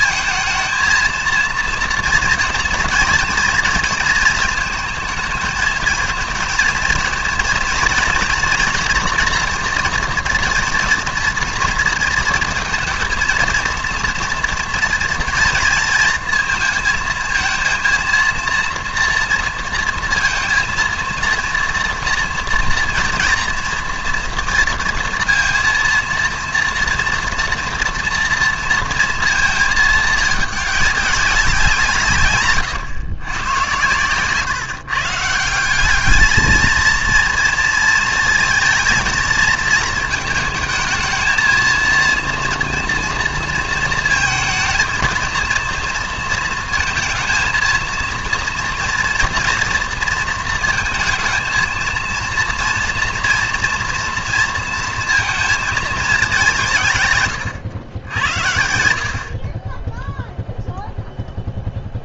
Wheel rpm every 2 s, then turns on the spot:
230, 230, 230, 230, 230, 230, 230, 230, 230, 230, 230, 230, 230, 230, 230, 210, 130, 150, 220, 230, 220, 230, 230, 230, 230, 230, 230, 230, 180, 90, 0.
none